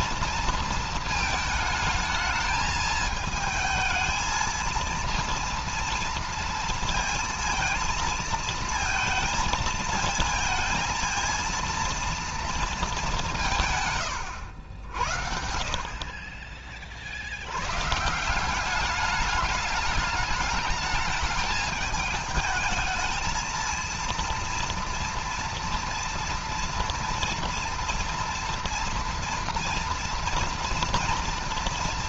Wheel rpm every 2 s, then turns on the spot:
230, 220, 230, 230, 230, 230, 230, 90, 40, 190, 210, 220, 230, 230, 230, 230.
none